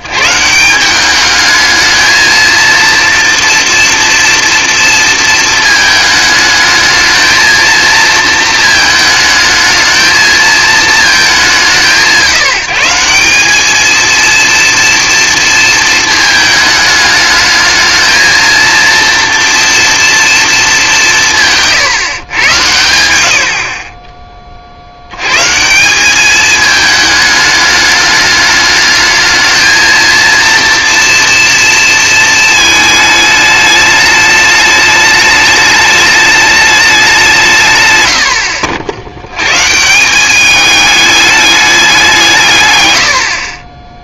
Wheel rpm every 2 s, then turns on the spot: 160, 230, 230, 210, 230, 220, 190, 230, 220, 230, 220, 120, 30, 210, 210, 230, 220, 210, 210, 70, 210, 150.
none